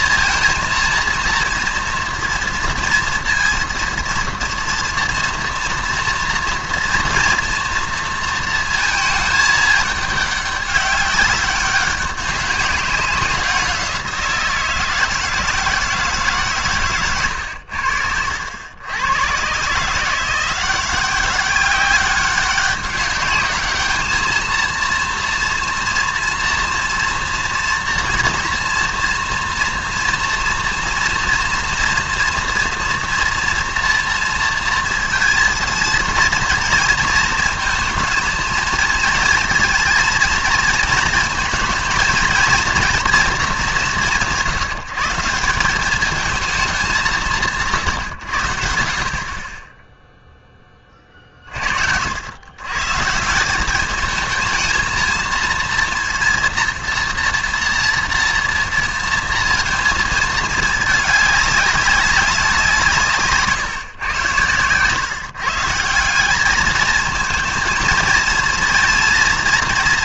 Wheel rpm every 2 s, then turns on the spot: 230, 230, 230, 230, 230, 200, 190, 170, 140, 80, 180, 200, 230, 230, 230, 230, 230, 230, 230, 220, 230, 240, 160, 210, 80, 20, 110, 220, 230, 230, 220, 190, 120, 200, 230.
none